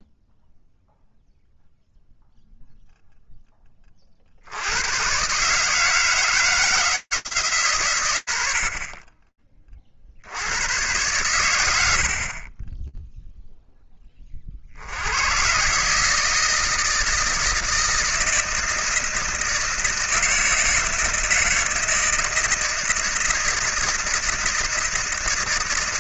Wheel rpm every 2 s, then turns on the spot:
0, 0, 60, 160, 100, 60, 40, 40, 160, 160, 160, 160, 160.
none